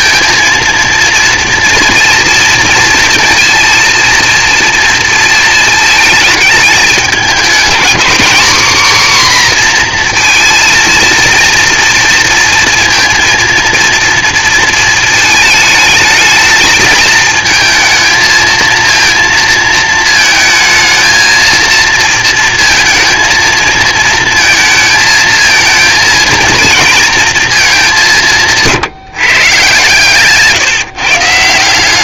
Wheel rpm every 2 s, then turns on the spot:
230, 230, 230, 210, 260, 230, 230, 230, 220, 230, 220, 230, 230, 230, 160, 150.
none